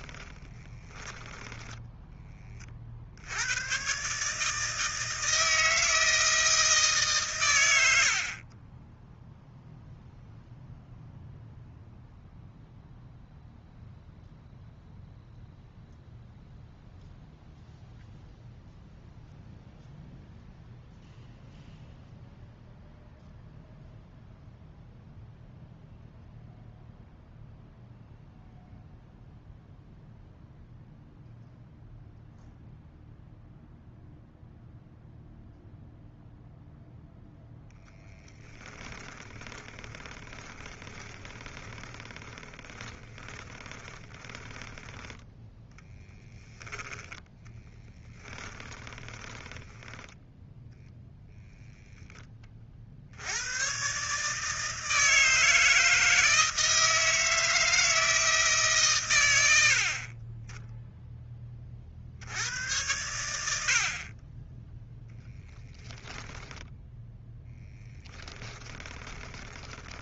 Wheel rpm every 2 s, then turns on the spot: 10, 40, 160, 160, 20, 0, 0, 0, 0, 0, 0, 0, 0, 0, 0, 0, 0, 0, 0, 20, 20, 10, 20, 20, 20, 0, 50, 160, 160, 140, 10, 100, 10, 10, 10.
0-2 38-46 48-50 66-70